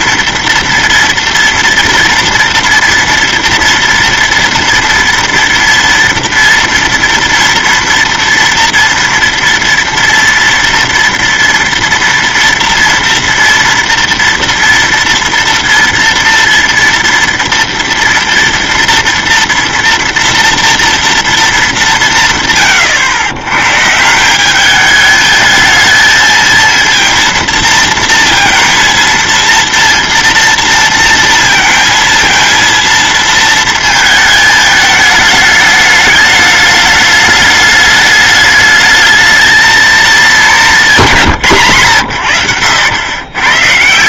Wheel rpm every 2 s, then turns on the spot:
230, 230, 230, 230, 230, 230, 230, 230, 230, 230, 230, 120, 210, 230, 230, 230, 230, 210, 210, 210, 190, 110.
none